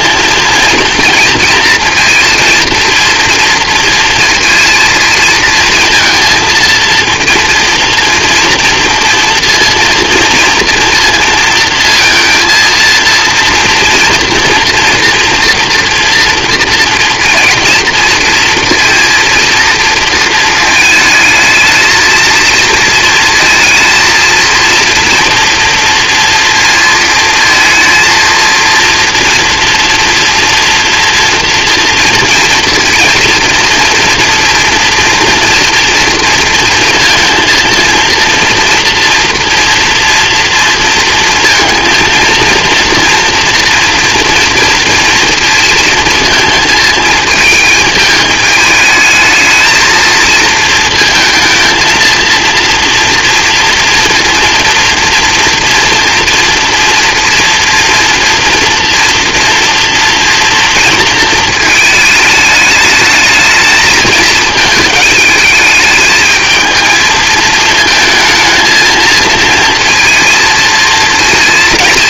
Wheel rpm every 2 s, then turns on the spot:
230, 230, 230, 230, 230, 230, 230, 230, 230, 230, 220, 230, 230, 230, 230, 230, 230, 230, 230, 230, 230, 230, 230, 220, 210, 230, 230, 230, 230, 230, 230, 210, 220, 220, 220, 230.
none